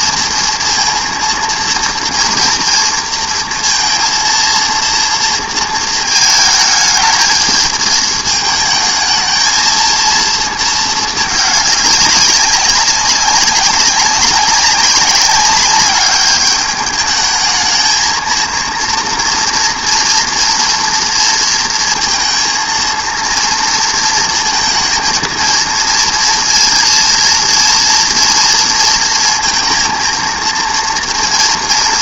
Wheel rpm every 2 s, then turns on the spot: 230, 230, 230, 220, 220, 220, 200, 190, 210, 230, 230, 230, 230, 230, 230, 230.
none